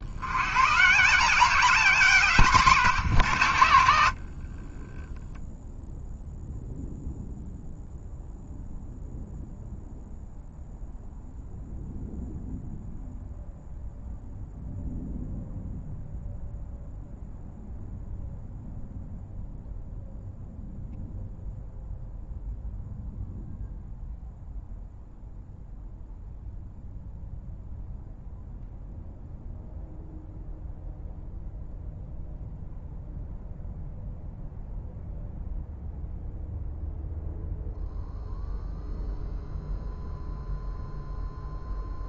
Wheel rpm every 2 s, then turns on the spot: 90, 170, 70, 0, 0, 0, 0, 0, 0, 0, 0, 0, 0, 0, 0, 0, 0, 0, 0, 0, 0.
none